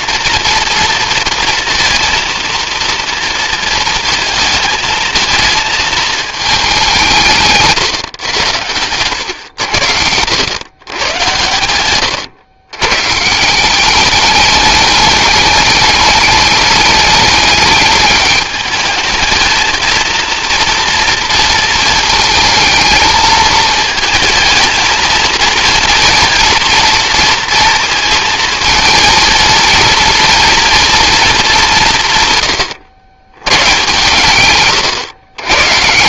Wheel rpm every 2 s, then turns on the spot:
230, 230, 220, 200, 100, 110, 130, 210, 210, 220, 230, 220, 230, 230, 230, 230, 100, 120.
none